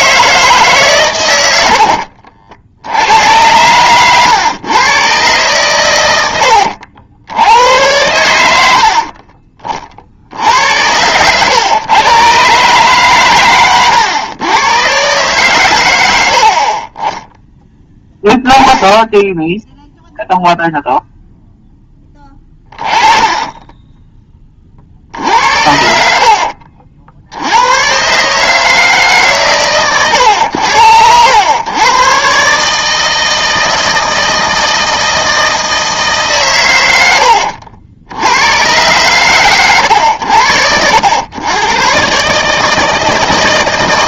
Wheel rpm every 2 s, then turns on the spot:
150, 80, 120, 80, 70, 90, 140, 110, 40, 10, 0, 20, 30, 60, 150, 100, 150, 160, 120, 100, 90, 150.
6-8 16-18 26-28